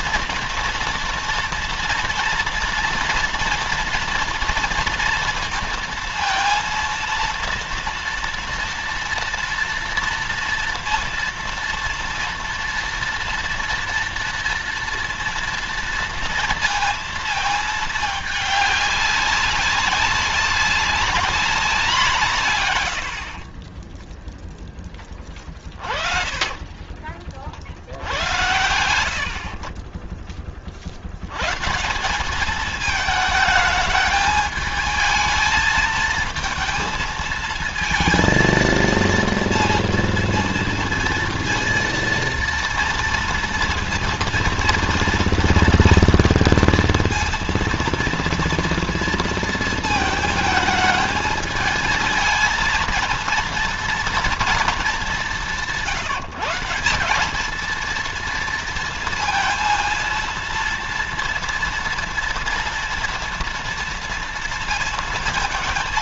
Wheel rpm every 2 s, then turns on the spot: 230, 230, 230, 230, 230, 230, 230, 230, 230, 200, 200, 90, 10, 30, 90, 70, 210, 220, 220, 230, 230, 230, 230, 230, 230, 220, 230, 210, 180, 230, 230, 240, 230.
26-28